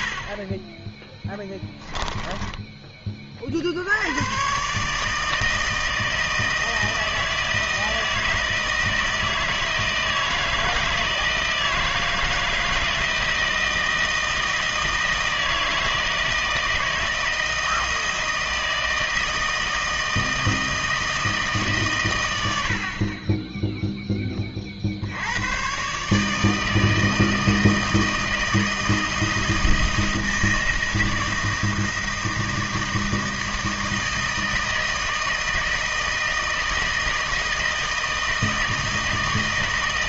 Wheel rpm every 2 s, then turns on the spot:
30, 10, 130, 160, 160, 160, 160, 160, 160, 160, 160, 80, 20, 160, 160, 160, 160, 160, 160, 160.
none